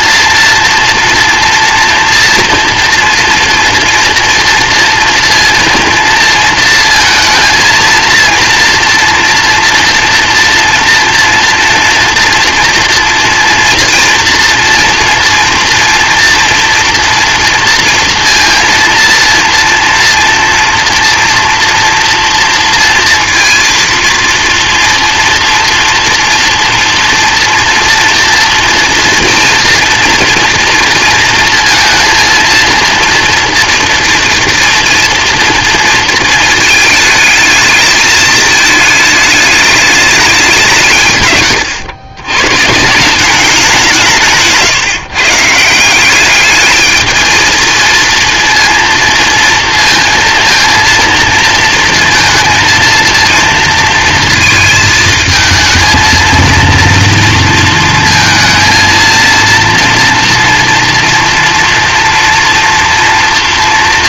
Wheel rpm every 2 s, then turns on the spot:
230, 230, 230, 230, 230, 240, 230, 230, 240, 230, 230, 230, 230, 230, 230, 230, 230, 230, 230, 220, 170, 140, 150, 210, 230, 230, 230, 230, 230, 230, 230, 230.
none